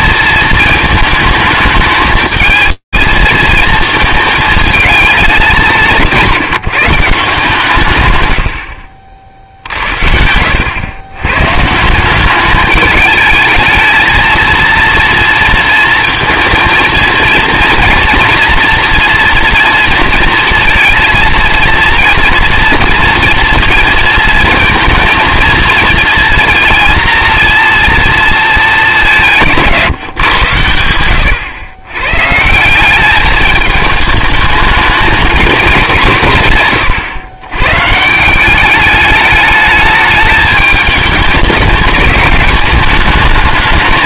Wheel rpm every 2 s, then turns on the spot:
230, 220, 210, 170, 60, 100, 210, 230, 230, 240, 230, 230, 230, 230, 190, 100, 190, 210, 110, 200, 210, 200.
none